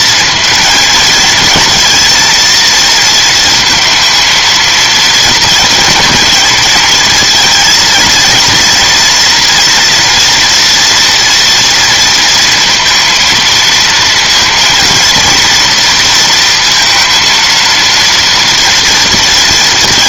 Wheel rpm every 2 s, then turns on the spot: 230, 230, 230, 220, 230, 230, 230, 230, 230, 230.
none